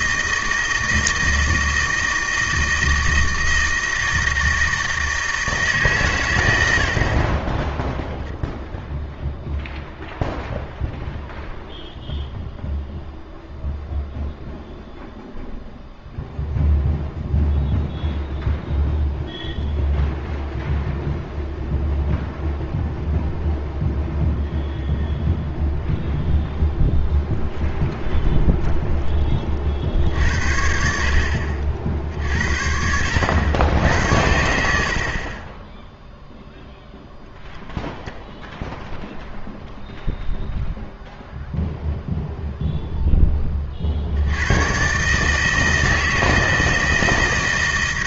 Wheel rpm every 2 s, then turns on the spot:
160, 160, 160, 80, 0, 0, 0, 0, 0, 0, 0, 0, 0, 0, 0, 60, 70, 70, 0, 10, 0, 0, 110, 160.
none